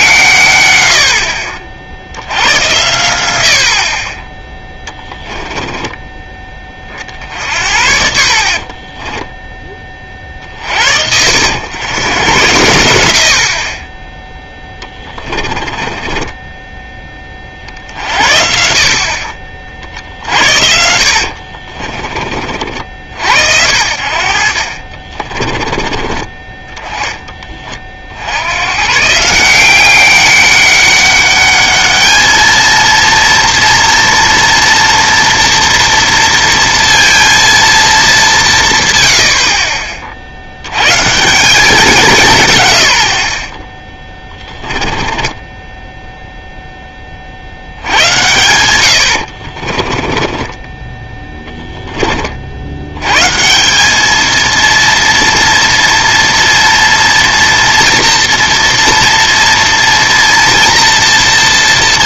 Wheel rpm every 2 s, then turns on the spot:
100, 90, 10, 20, 40, 60, 90, 10, 10, 50, 80, 50, 50, 20, 110, 200, 230, 230, 230, 160, 90, 130, 20, 10, 100, 20, 70, 230, 230, 230, 230.
8-10 14-18 20-22 48-52